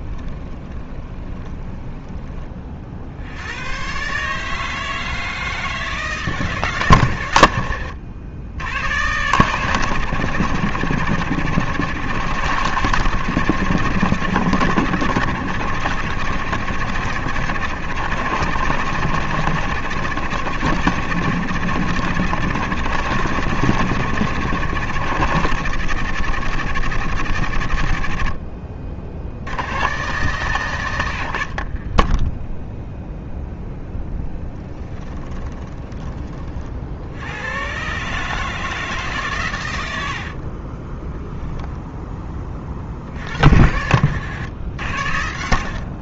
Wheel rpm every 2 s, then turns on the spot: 20, 50, 160, 140, 100, 100, 110, 100, 100, 110, 110, 110, 100, 100, 50, 120, 10, 20, 50, 150, 40, 40, 90.
0-2 34-36 40-42